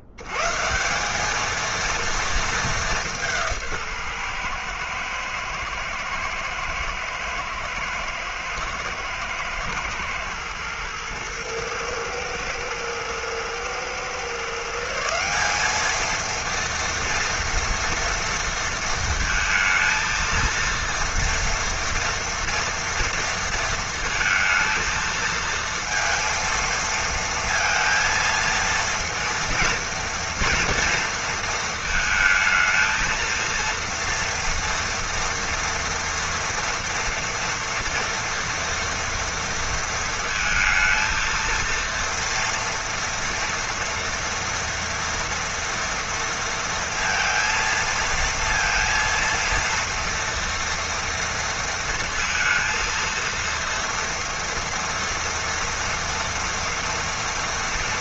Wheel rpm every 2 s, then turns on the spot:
80, 220, 120, 110, 120, 120, 110, 140, 230, 230, 230, 230, 230, 230, 230, 240, 220, 230, 240, 230, 230, 230, 230, 230, 230, 230, 230, 230, 230.
none